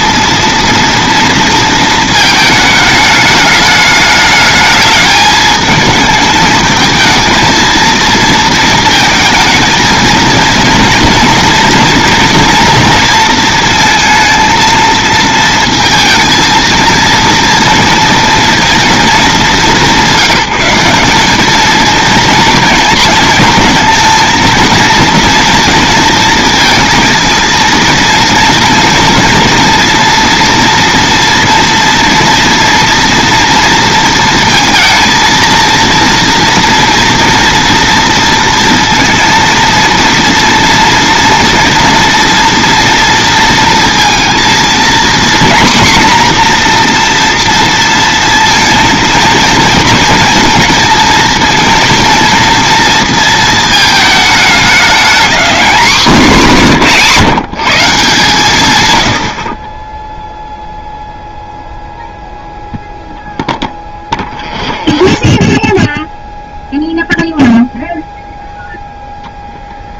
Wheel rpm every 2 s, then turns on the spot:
230, 220, 210, 220, 220, 230, 230, 230, 230, 230, 190, 230, 230, 230, 230, 230, 230, 230, 230, 230, 230, 230, 230, 240, 230, 230, 230, 210, 180, 110, 0, 0, 0, 0, 0.
none